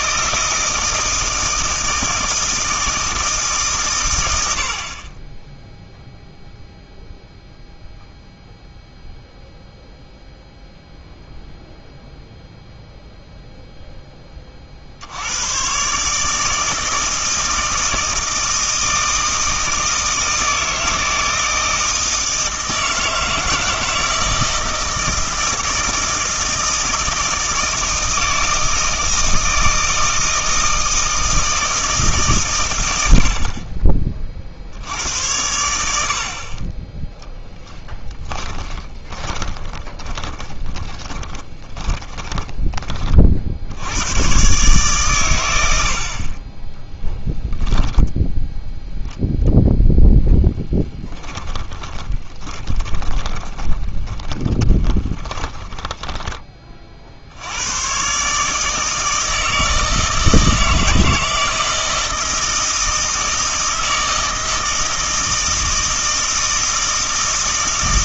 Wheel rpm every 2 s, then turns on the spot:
160, 160, 60, 0, 0, 0, 0, 50, 160, 160, 160, 160, 160, 160, 160, 160, 110, 70, 30, 20, 20, 20, 140, 10, 0, 10, 20, 20, 40, 160, 160, 160, 160, 160.
38-42 50-56